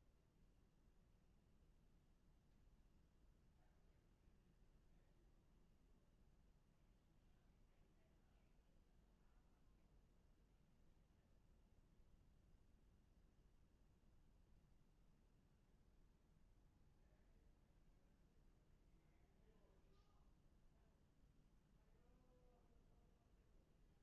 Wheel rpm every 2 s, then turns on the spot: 0, 0, 0, 0, 0, 0, 0, 0, 0, 0, 0, 0.
none